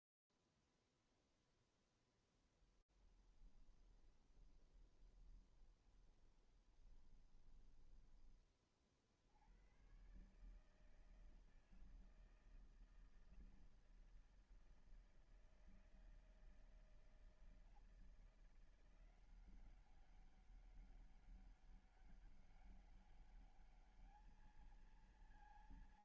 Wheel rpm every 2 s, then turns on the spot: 0, 0, 20, 20, 20, 120, 160, 160, 160, 170, 190, 200, 220.
4-8